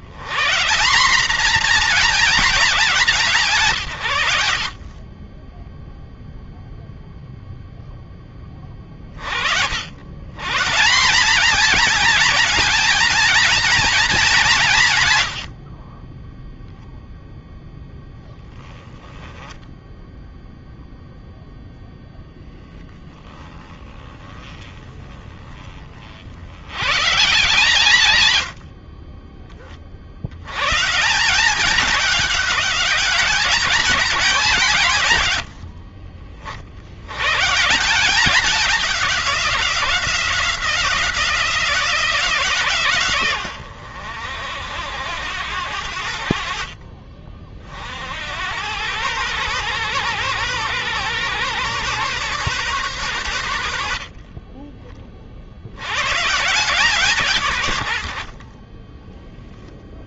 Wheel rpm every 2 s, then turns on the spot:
130, 210, 90, 0, 20, 130, 220, 210, 10, 10, 0, 0, 20, 70, 120, 90, 200, 190, 40, 200, 180, 160, 80, 60, 70, 130, 130, 50, 120, 60.
none